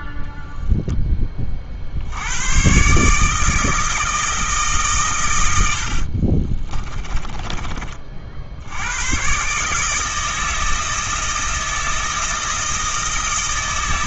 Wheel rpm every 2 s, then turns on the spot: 10, 130, 130, 20, 90, 160, 160.
6-8